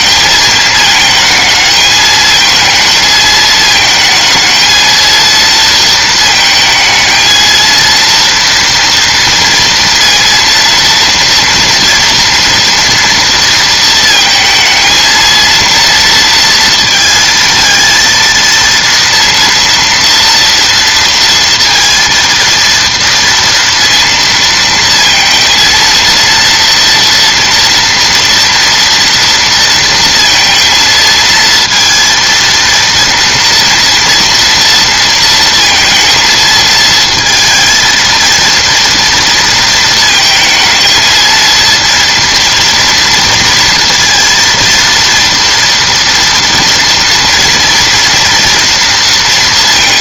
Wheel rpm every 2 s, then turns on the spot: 220, 220, 230, 220, 230, 230, 230, 220, 230, 230, 230, 230, 230, 230, 230, 220, 230, 230, 220, 230, 220, 230, 230, 230, 230.
none